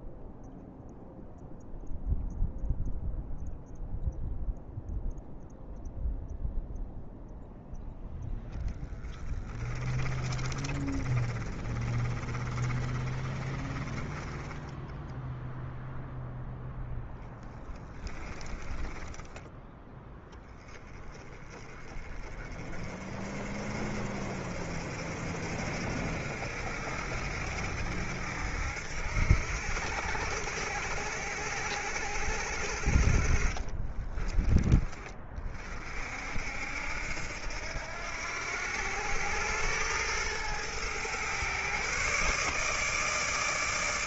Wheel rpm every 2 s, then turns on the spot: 0, 0, 0, 0, 10, 20, 20, 10, 0, 10, 20, 40, 60, 70, 70, 70, 70, 30, 70, 90, 110, 150.
10-14 18-20